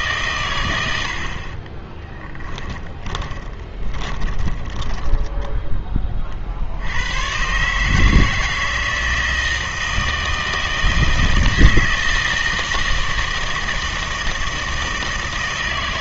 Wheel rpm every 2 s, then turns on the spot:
110, 20, 10, 60, 160, 160, 160, 160.
2-6